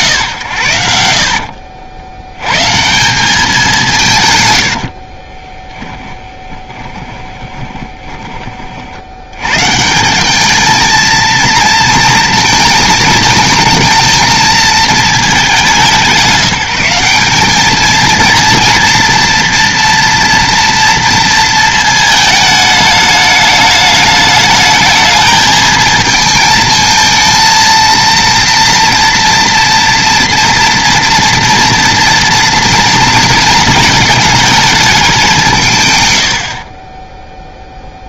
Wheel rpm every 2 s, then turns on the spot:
110, 110, 120, 10, 40, 210, 230, 220, 180, 230, 230, 220, 210, 220, 230, 230, 230, 220, 30.
6-8